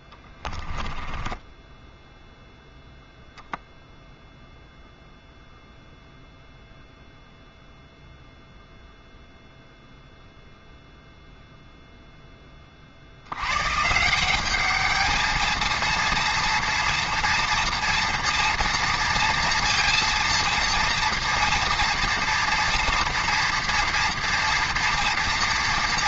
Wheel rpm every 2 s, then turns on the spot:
20, 0, 0, 0, 0, 0, 30, 210, 230, 230, 230, 230, 230.
0-2